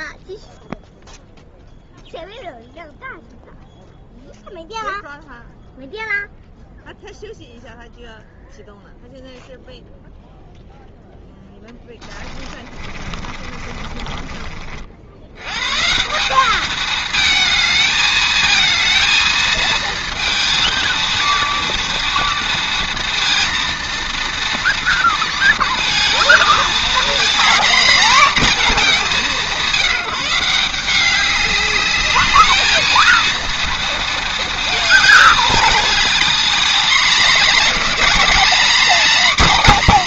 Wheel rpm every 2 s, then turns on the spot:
0, 0, 0, 0, 0, 0, 30, 50, 210, 220, 230, 230, 230, 240, 220, 180, 220, 220, 230, 250.
12-14